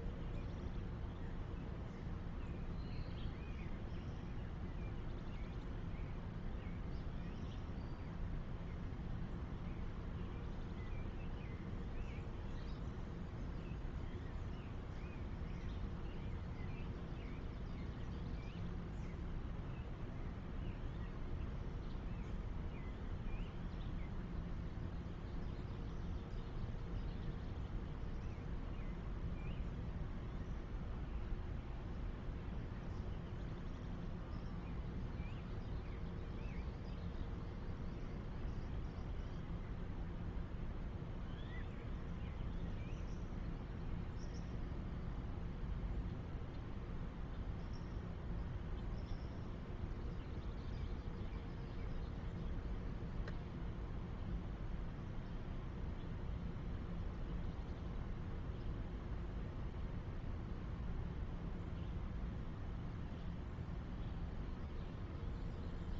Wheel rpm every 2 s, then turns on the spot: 0, 0, 0, 0, 0, 0, 0, 0, 0, 0, 0, 0, 0, 0, 0, 0, 0, 0, 0, 0, 0, 0, 0, 0, 0, 0, 0, 0, 0, 0, 0, 0, 0.
none